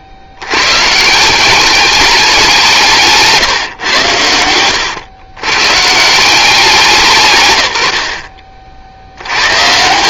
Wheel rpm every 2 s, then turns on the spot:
120, 180, 100, 180, 60.
none